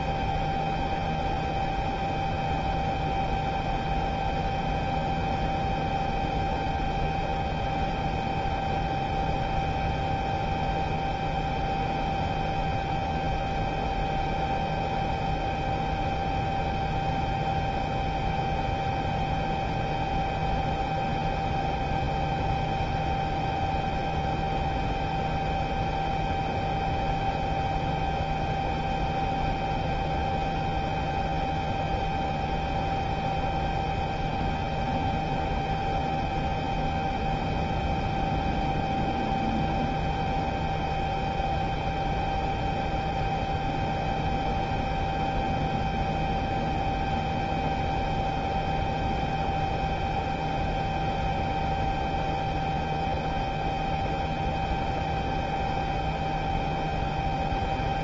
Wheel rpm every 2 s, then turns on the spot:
0, 0, 0, 0, 0, 0, 0, 0, 0, 0, 0, 0, 0, 0, 0, 0, 0, 0, 0, 0, 0, 0, 0, 0, 0, 0, 0, 0, 0.
none